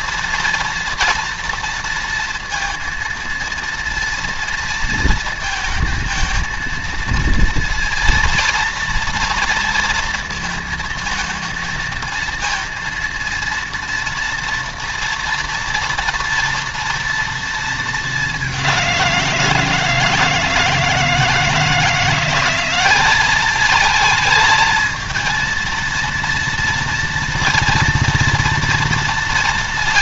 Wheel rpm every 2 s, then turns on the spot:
230, 230, 230, 230, 230, 230, 230, 230, 240, 190, 160, 190, 220, 230, 230.
none